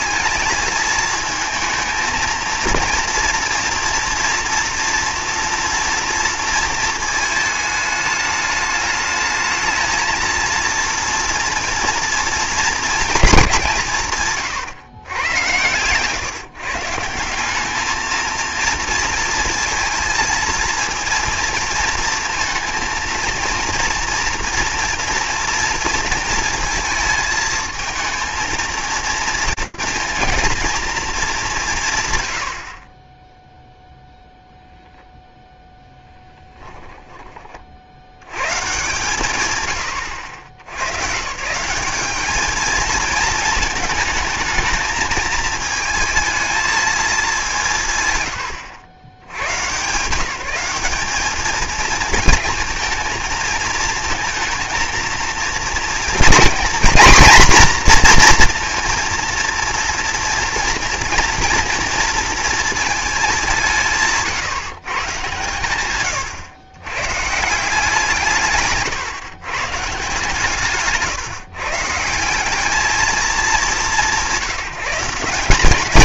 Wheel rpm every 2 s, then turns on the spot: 220, 230, 230, 220, 210, 230, 210, 110, 150, 230, 230, 230, 230, 220, 230, 220, 30, 0, 10, 130, 100, 220, 220, 220, 90, 200, 230, 230, 240, 240, 230, 220, 140, 120, 150, 150, 210, 170.
36-38